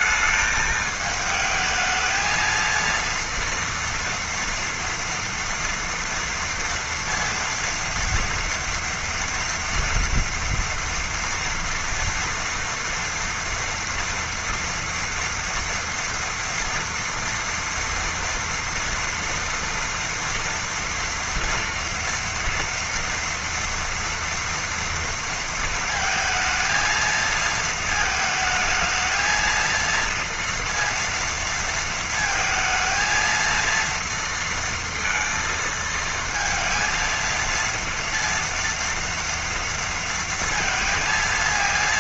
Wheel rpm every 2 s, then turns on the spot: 220, 220, 240, 230, 230, 230, 230, 240, 230, 230, 230, 230, 230, 230, 220, 230, 230, 230, 230, 230, 230.
none